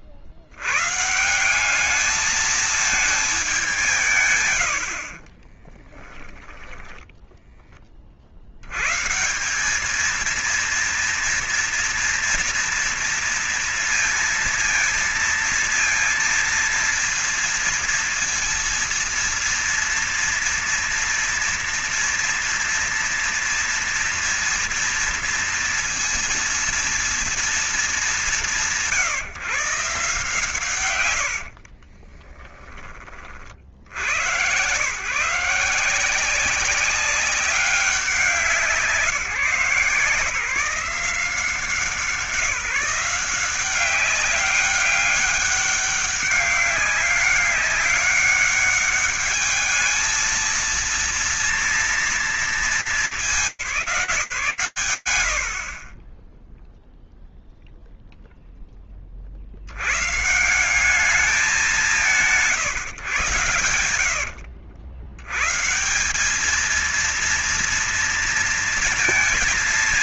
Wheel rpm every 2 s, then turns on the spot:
110, 180, 190, 30, 40, 200, 230, 230, 230, 230, 230, 230, 230, 230, 210, 150, 40, 110, 180, 180, 160, 160, 190, 200, 200, 220, 230, 160, 10, 10, 150, 160, 80, 200, 230.
0-2 6-8 32-34